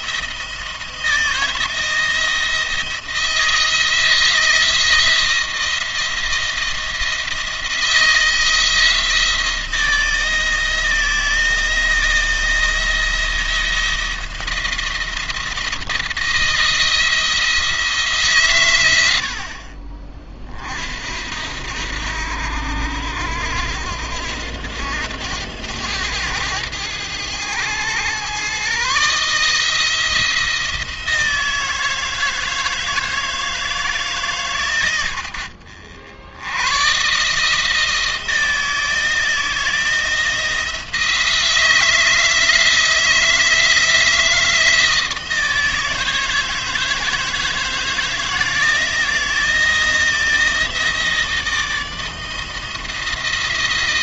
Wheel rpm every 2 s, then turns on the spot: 170, 170, 170, 170, 160, 160, 170, 170, 170, 100, 50, 80, 100, 110, 130, 170, 160, 120, 120, 160, 170, 160, 160, 160, 170, 160, 160.
none